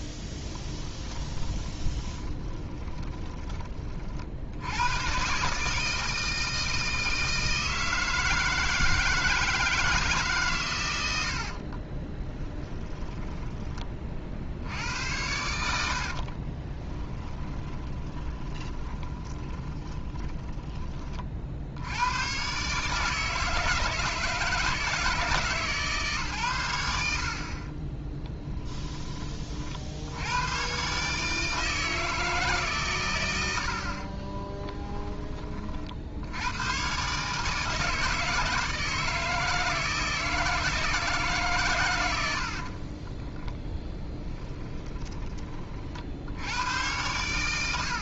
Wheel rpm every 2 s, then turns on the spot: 20, 20, 90, 160, 160, 120, 10, 70, 30, 20, 20, 130, 160, 100, 10, 130, 140, 20, 110, 160, 160, 50, 10, 100.
0-4 12-14 16-20 34-36 42-44